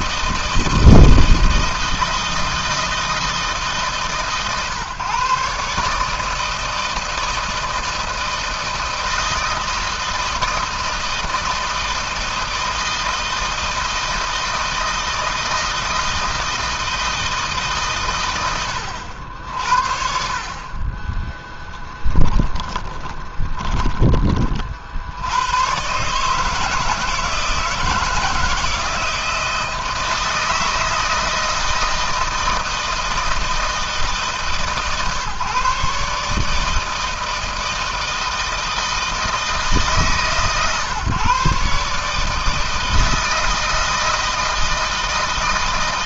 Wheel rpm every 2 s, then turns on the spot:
160, 160, 140, 160, 160, 160, 160, 160, 160, 80, 30, 10, 60, 160, 160, 160, 160, 140, 160, 160, 140, 160, 160.
20-24